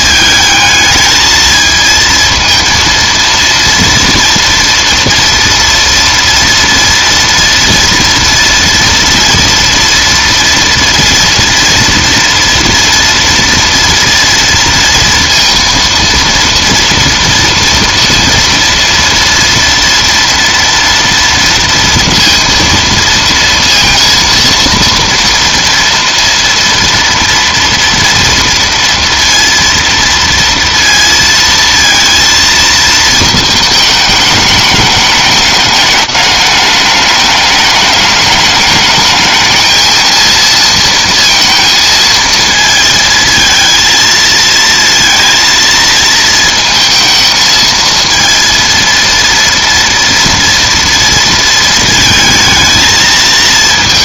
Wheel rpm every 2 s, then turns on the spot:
220, 230, 230, 230, 230, 230, 230, 230, 230, 230, 230, 230, 230, 230, 230, 230, 220, 210, 210, 220, 230, 220, 230, 220, 230, 230, 220.
none